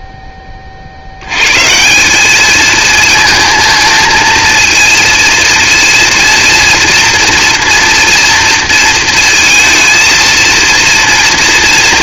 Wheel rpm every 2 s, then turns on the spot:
30, 210, 230, 230, 230, 230.
none